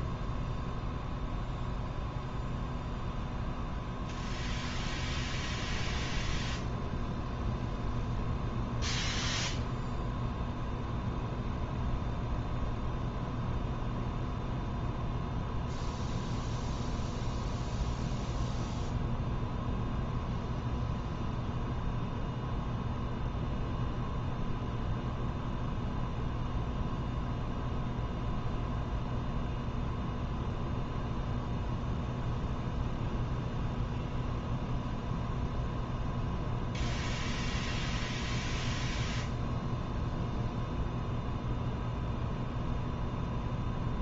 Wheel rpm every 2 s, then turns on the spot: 0, 0, 0, 0, 0, 0, 0, 0, 0, 0, 0, 0, 0, 0, 0, 0, 0, 0, 0, 0, 0, 0.
none